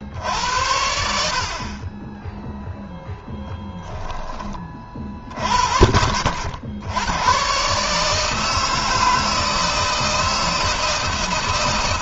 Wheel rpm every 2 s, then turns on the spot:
60, 0, 20, 90, 160, 160.
none